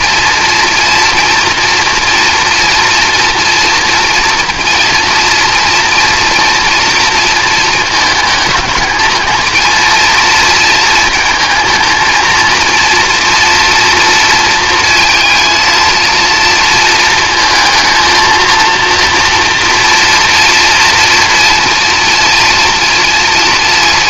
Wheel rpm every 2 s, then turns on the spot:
230, 230, 240, 240, 230, 230, 230, 230, 230, 230, 240, 230.
none